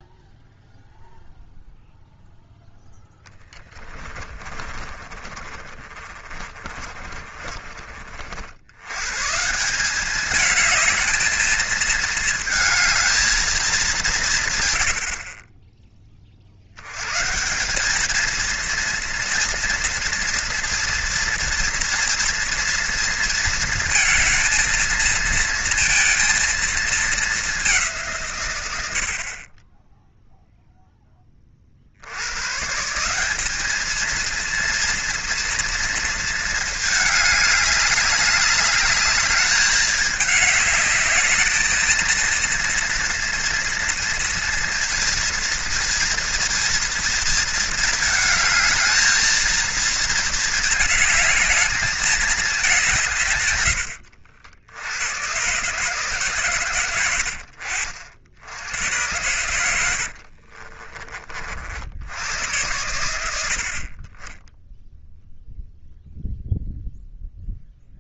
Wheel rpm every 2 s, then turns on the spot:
0, 0, 20, 20, 90, 210, 220, 110, 80, 230, 230, 230, 220, 220, 90, 0, 130, 230, 220, 200, 210, 230, 230, 230, 220, 220, 200, 90, 120, 90, 50, 100, 10, 0.
4-8 60-62